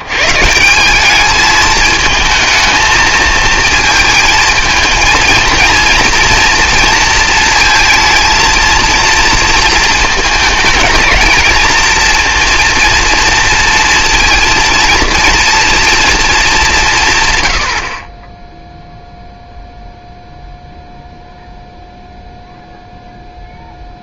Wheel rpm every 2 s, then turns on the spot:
170, 220, 220, 230, 230, 220, 230, 230, 200, 0, 0, 0.
none